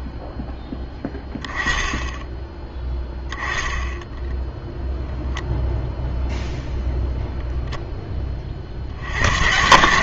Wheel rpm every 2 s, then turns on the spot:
10, 10, 0, 0, 60.
none